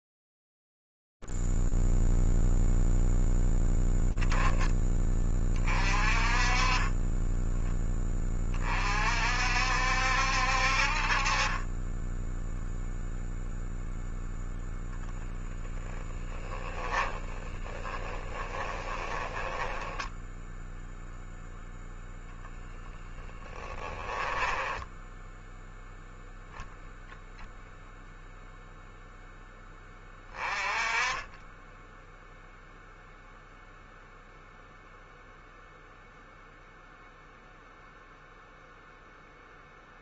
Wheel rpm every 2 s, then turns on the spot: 0, 0, 10, 30, 20, 60, 10, 0, 10, 10, 10, 0, 10, 0, 0, 20, 0, 0, 0, 0.
16-20 24-26